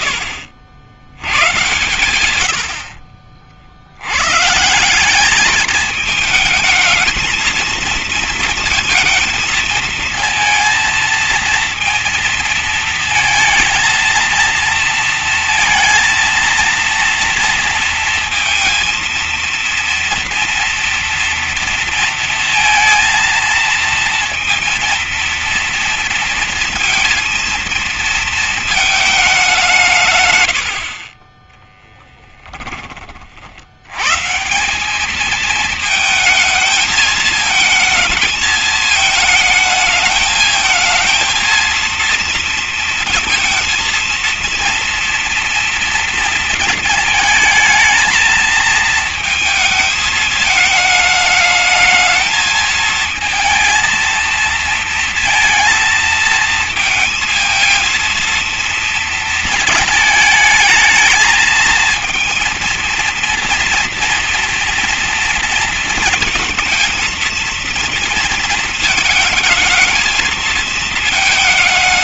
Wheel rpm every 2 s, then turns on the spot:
60, 110, 150, 220, 230, 230, 230, 230, 230, 230, 230, 230, 230, 230, 220, 90, 10, 160, 220, 220, 220, 230, 230, 220, 220, 220, 220, 230, 230, 230, 220, 230, 230, 230, 230, 220.
30-32